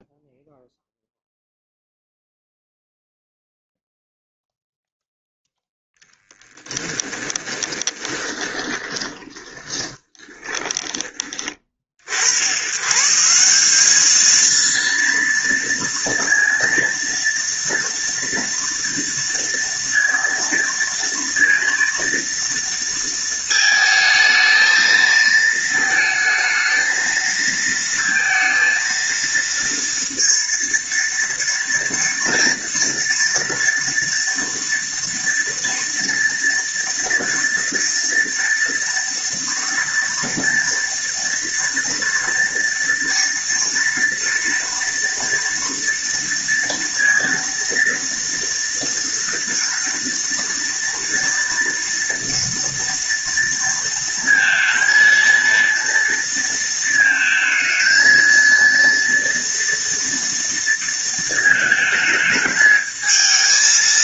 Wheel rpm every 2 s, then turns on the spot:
0, 0, 0, 10, 20, 20, 130, 230, 230, 230, 230, 230, 220, 220, 230, 230, 230, 230, 230, 230, 230, 230, 230, 230, 230, 230, 230, 230, 230, 230, 230, 220.
8-12